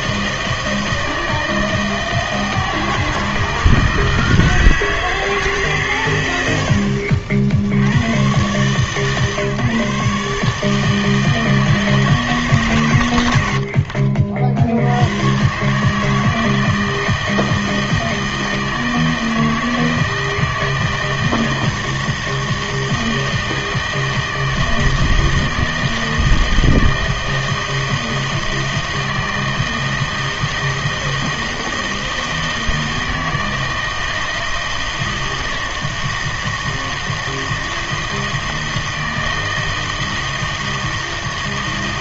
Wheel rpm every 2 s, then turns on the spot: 160, 160, 160, 70, 130, 160, 130, 70, 160, 160, 160, 160, 160, 160, 160, 160, 160, 160, 160, 160, 160.
none